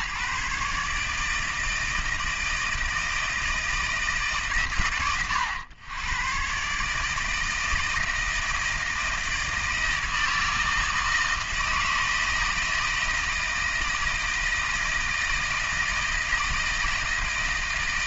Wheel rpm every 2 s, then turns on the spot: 150, 160, 130, 140, 170, 160, 160, 160, 160.
none